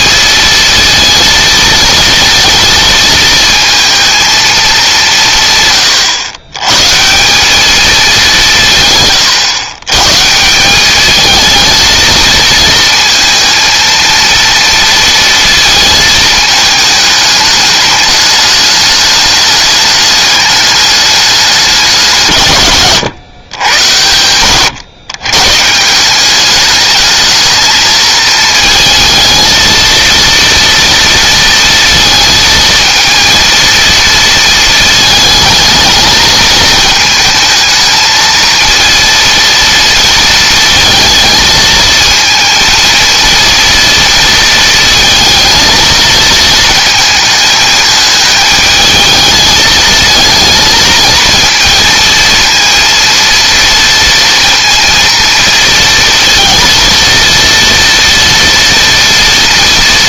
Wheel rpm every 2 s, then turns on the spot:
230, 220, 200, 130, 150, 190, 230, 230, 220, 210, 210, 120, 90, 210, 220, 230, 220, 220, 220, 230, 220, 220, 230, 220, 220, 230, 230, 230, 230, 230.
none